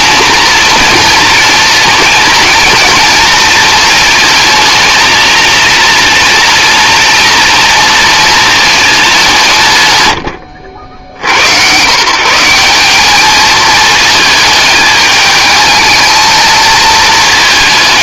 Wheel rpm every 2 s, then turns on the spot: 230, 230, 220, 230, 220, 90, 190, 210, 220.
none